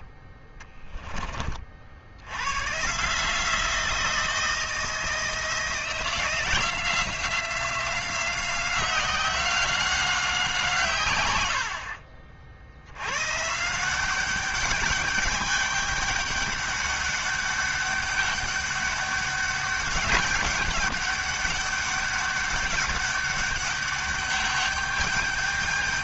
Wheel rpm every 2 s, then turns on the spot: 20, 110, 170, 170, 180, 170, 70, 200, 200, 200, 200, 200, 200.
0-2